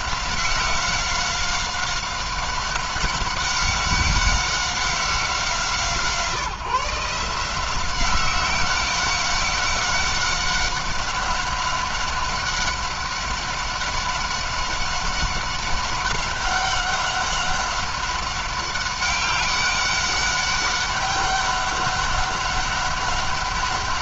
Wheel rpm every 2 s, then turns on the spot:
190, 190, 190, 150, 190, 200, 200, 190, 190, 190, 200, 190.
none